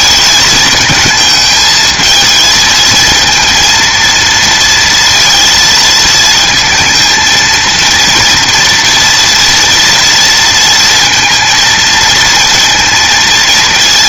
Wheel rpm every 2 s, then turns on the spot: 220, 220, 230, 230, 240, 230, 230.
none